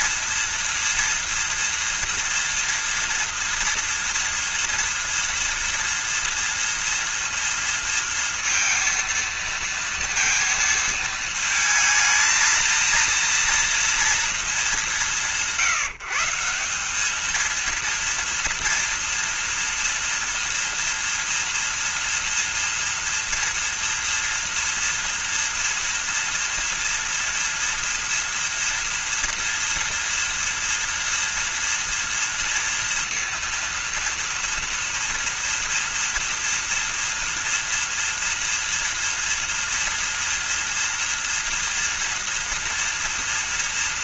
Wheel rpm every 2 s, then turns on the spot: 230, 230, 230, 230, 230, 230, 230, 190, 190, 230, 230, 230, 230, 230, 230, 230, 230, 230, 240, 240, 230, 230.
none